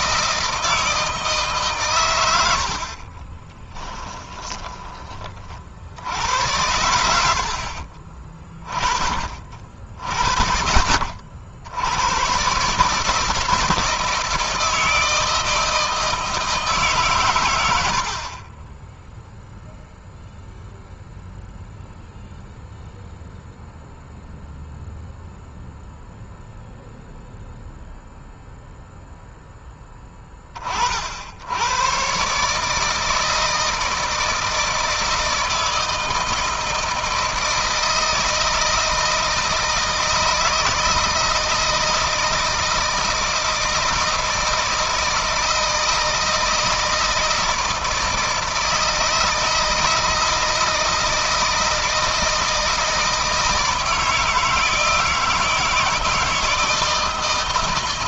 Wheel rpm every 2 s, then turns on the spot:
160, 60, 20, 80, 20, 70, 140, 160, 130, 10, 0, 0, 0, 0, 0, 40, 160, 160, 160, 160, 160, 160, 160, 160, 160, 160, 160, 160, 160.
2-4 18-20